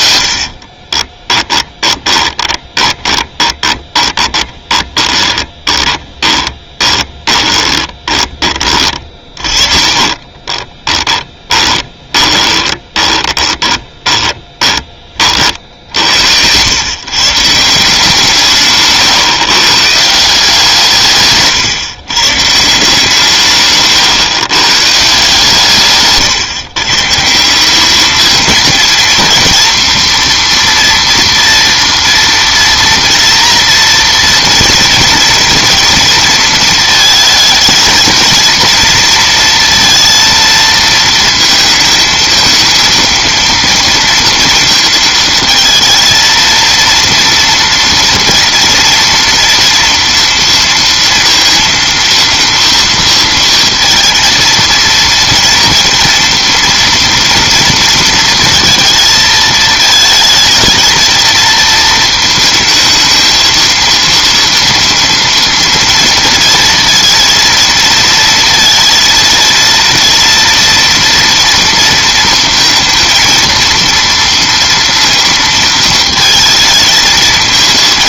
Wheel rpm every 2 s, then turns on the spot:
40, 20, 20, 20, 20, 20, 20, 20, 120, 140, 160, 160, 140, 140, 230, 240, 230, 230, 230, 230, 230, 220, 230, 230, 240, 230, 230, 230, 240, 220, 230, 220, 230, 230, 230, 230, 230, 230, 220.
0-14 18-20